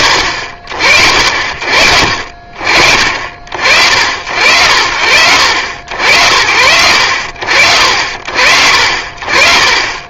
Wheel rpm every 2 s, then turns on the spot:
60, 50, 60, 80, 60.
none